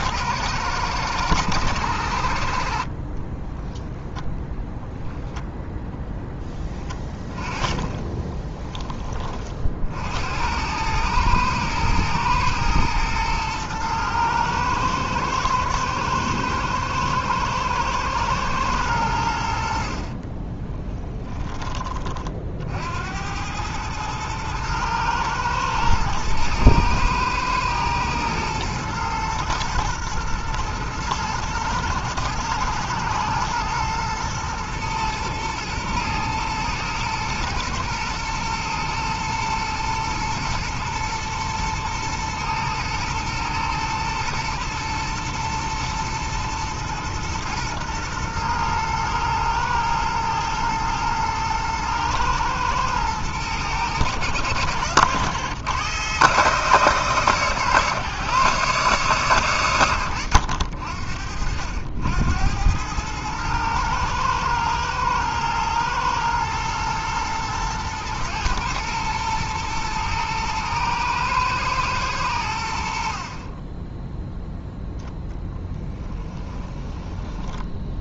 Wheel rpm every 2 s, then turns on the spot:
110, 60, 0, 20, 20, 100, 110, 110, 110, 100, 20, 60, 110, 110, 110, 110, 110, 110, 110, 120, 110, 110, 120, 110, 120, 110, 110, 100, 140, 130, 60, 100, 110, 110, 120, 110, 70, 0, 20.
6-8 20-22 76-78